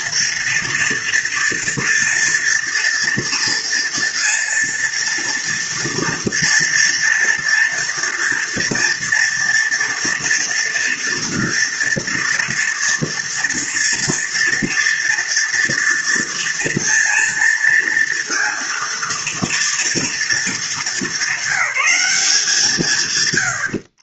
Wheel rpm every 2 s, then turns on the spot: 230, 230, 230, 230, 230, 230, 230, 230, 230, 230, 220, 120.
none